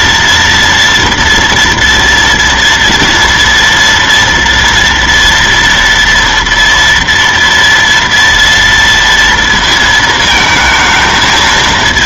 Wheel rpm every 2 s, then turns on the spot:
230, 240, 240, 230, 230, 220.
none